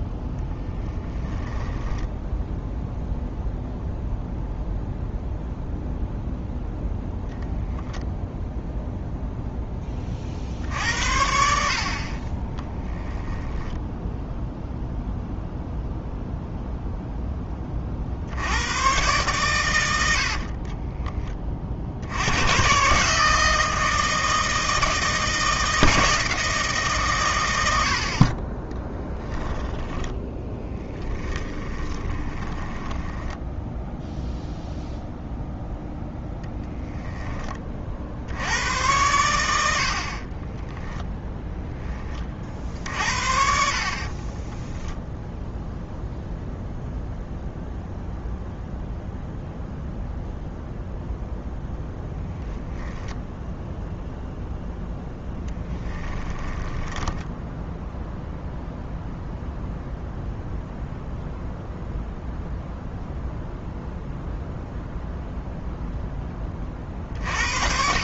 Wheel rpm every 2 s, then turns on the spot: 10, 0, 0, 10, 0, 60, 20, 0, 0, 110, 30, 130, 160, 140, 10, 10, 10, 0, 0, 90, 10, 50, 10, 0, 0, 0, 10, 0, 10, 0, 0, 0, 0, 40.
12-14 20-22 28-34 44-46 52-54 56-58